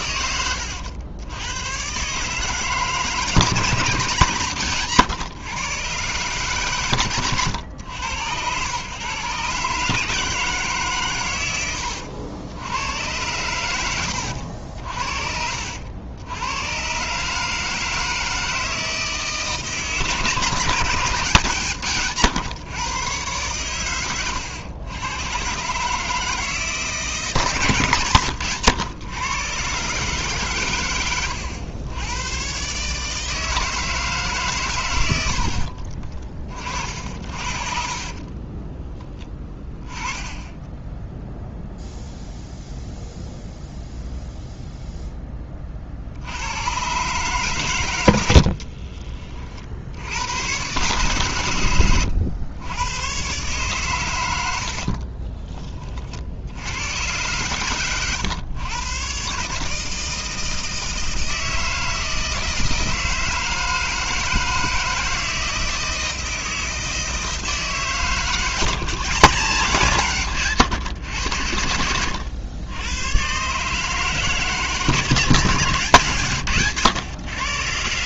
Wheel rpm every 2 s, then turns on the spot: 90, 150, 130, 140, 120, 140, 90, 60, 110, 160, 150, 130, 100, 160, 120, 130, 130, 110, 50, 10, 10, 0, 0, 110, 40, 120, 100, 70, 90, 110, 160, 160, 160, 160, 150, 110, 100, 150, 130.
40-42 48-50 54-56